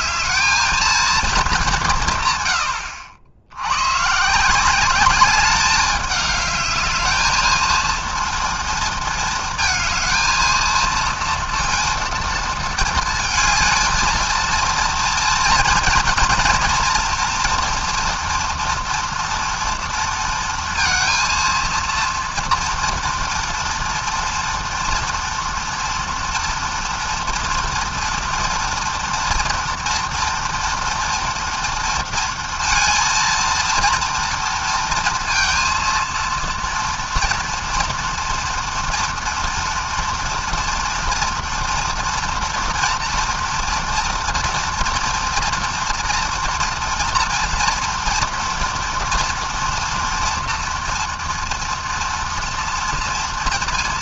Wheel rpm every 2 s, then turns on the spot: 220, 70, 200, 220, 230, 230, 220, 230, 240, 240, 230, 230, 230, 230, 230, 230, 230, 230, 230, 240, 230, 230, 230, 230, 230, 230, 230.
none